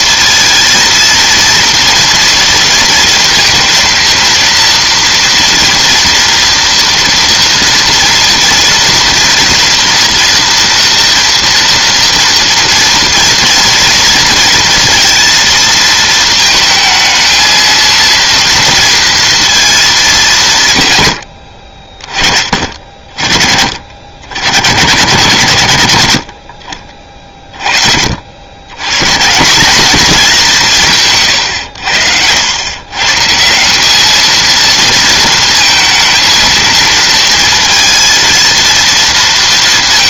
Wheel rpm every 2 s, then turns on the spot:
230, 230, 230, 230, 230, 230, 230, 230, 220, 230, 120, 60, 130, 50, 90, 190, 100, 220, 230, 230.
none